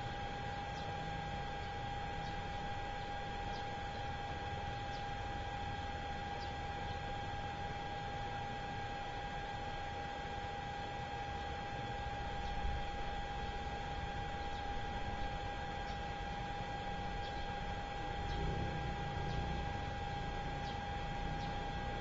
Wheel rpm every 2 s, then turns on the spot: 0, 0, 0, 0, 0, 0, 0, 0, 0, 0, 0.
none